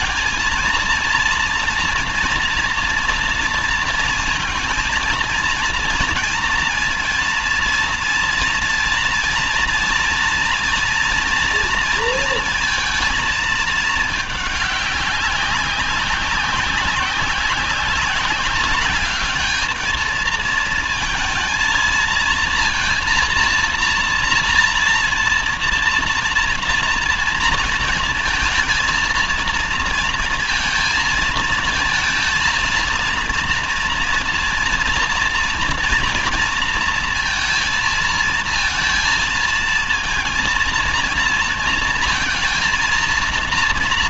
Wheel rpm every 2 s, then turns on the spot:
230, 240, 220, 230, 230, 230, 230, 200, 190, 200, 220, 230, 230, 230, 220, 230, 230, 230, 230, 220, 230, 230.
none